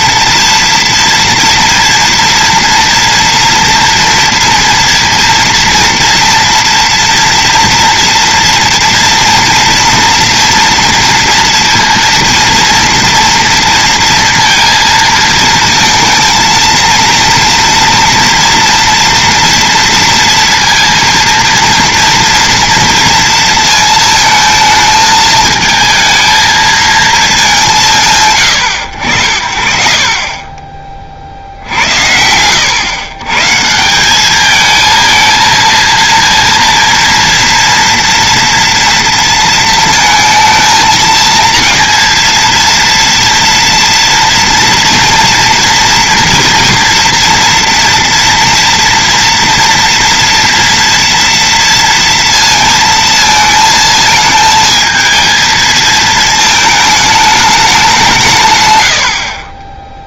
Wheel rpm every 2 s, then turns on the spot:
230, 230, 240, 230, 230, 240, 230, 230, 230, 230, 230, 230, 220, 220, 110, 30, 100, 220, 230, 230, 230, 230, 230, 230, 230, 230, 230, 220, 220, 120.
58-60